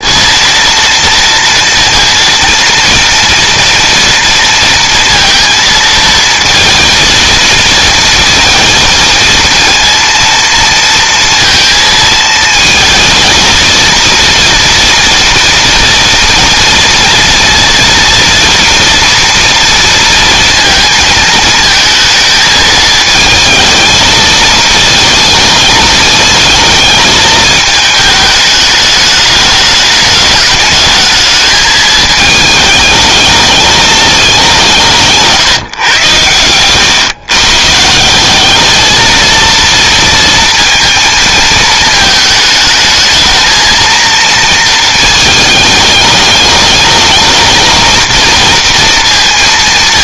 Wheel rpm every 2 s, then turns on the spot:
230, 230, 230, 230, 230, 230, 220, 230, 230, 230, 220, 220, 220, 220, 210, 220, 210, 160, 130, 220, 230, 220, 220, 220, 230.
none